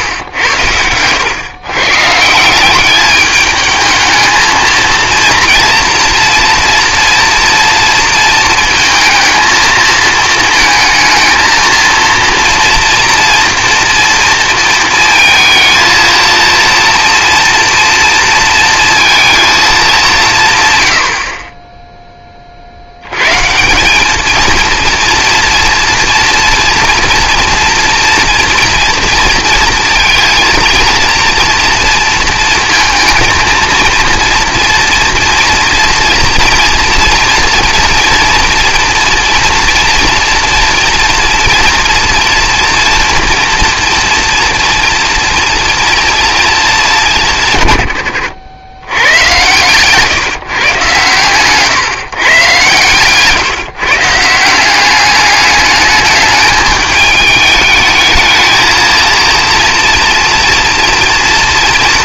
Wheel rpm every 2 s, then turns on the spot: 120, 160, 220, 240, 220, 220, 230, 230, 230, 230, 160, 20, 210, 230, 240, 230, 220, 230, 230, 230, 230, 230, 230, 230, 90, 150, 130, 160, 210, 220, 240.
none